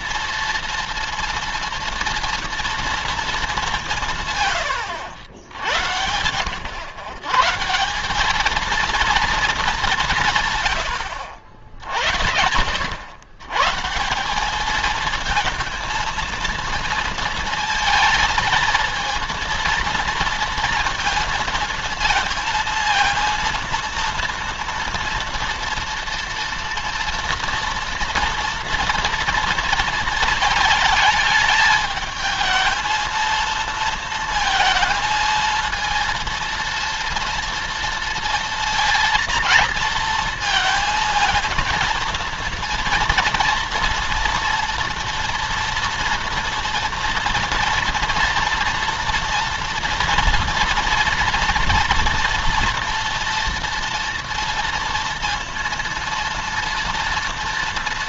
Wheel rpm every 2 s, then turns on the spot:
230, 230, 120, 90, 220, 140, 70, 200, 230, 220, 230, 220, 230, 230, 240, 220, 220, 230, 230, 230, 220, 230, 230, 230, 230, 230, 230, 230, 230.
none